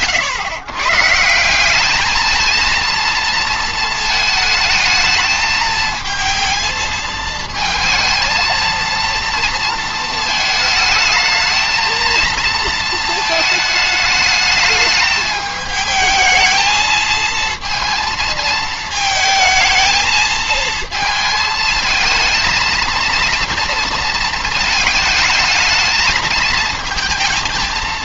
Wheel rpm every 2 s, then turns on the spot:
110, 230, 220, 220, 230, 220, 230, 220, 220, 220, 220, 230, 230, 220.
none